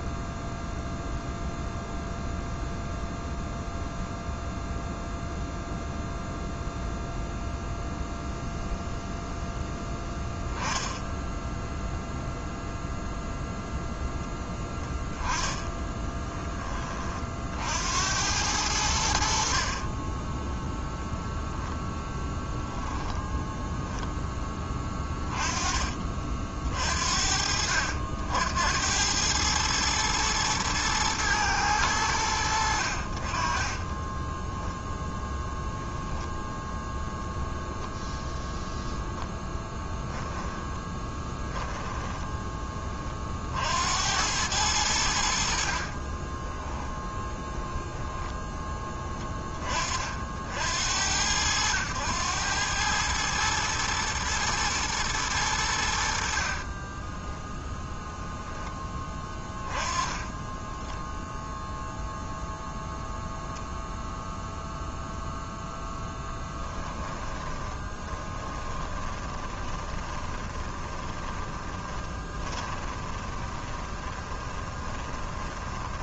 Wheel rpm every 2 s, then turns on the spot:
0, 0, 0, 0, 0, 10, 0, 0, 10, 90, 20, 10, 10, 40, 80, 110, 80, 10, 0, 0, 10, 20, 100, 20, 10, 60, 100, 120, 40, 10, 20, 0, 0, 10, 20, 20, 20, 20.
10-12 40-42 46-50 56-58 66-76